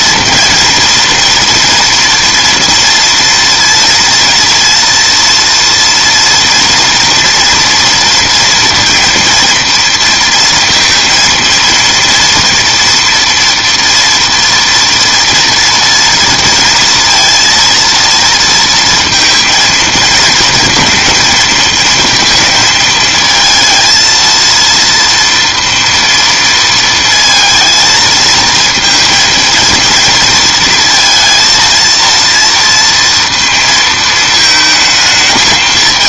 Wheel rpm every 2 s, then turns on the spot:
230, 230, 230, 230, 230, 230, 230, 230, 230, 230, 220, 230, 230, 230, 230, 230, 230, 220.
none